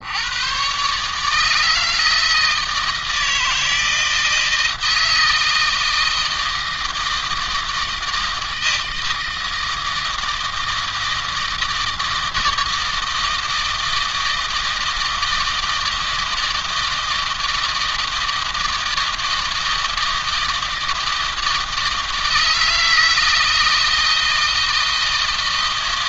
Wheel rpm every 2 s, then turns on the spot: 120, 160, 160, 160, 160, 160, 160, 160, 160, 160, 160, 160, 160.
none